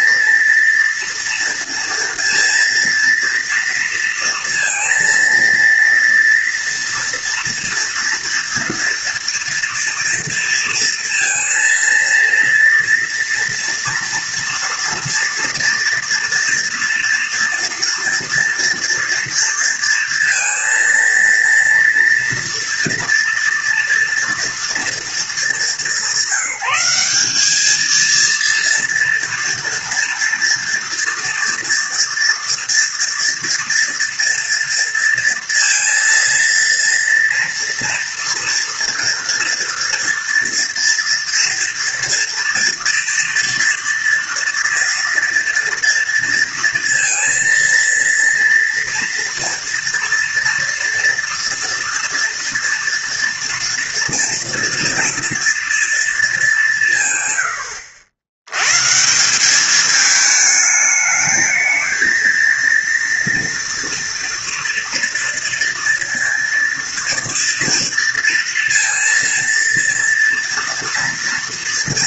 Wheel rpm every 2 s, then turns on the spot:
230, 230, 230, 240, 240, 230, 230, 230, 230, 230, 230, 230, 230, 190, 230, 230, 230, 230, 230, 230, 230, 240, 230, 230, 230, 240, 240, 230, 200, 110, 210, 230, 230, 230, 230, 240.
none